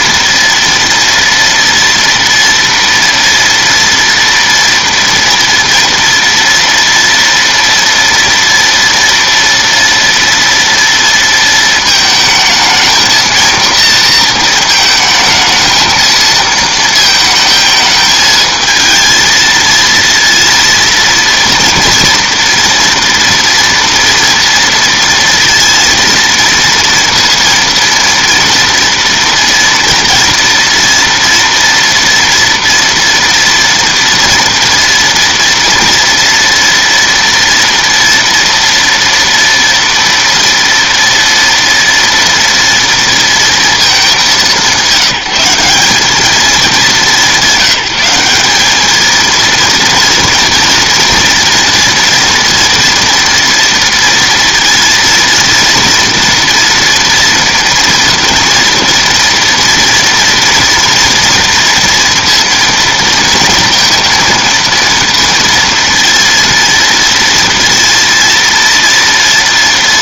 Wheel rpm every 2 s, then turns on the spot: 230, 230, 230, 230, 230, 230, 220, 230, 230, 220, 230, 230, 230, 230, 230, 230, 230, 230, 230, 230, 230, 230, 200, 210, 200, 230, 230, 230, 230, 230, 230, 230, 230, 230, 230.
none